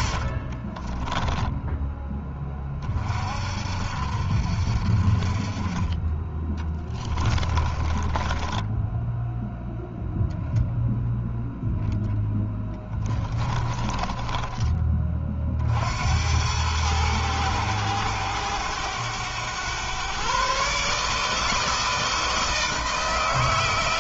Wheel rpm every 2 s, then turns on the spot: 20, 40, 40, 20, 10, 0, 20, 30, 110, 100, 150, 160.
0-2 6-10 12-14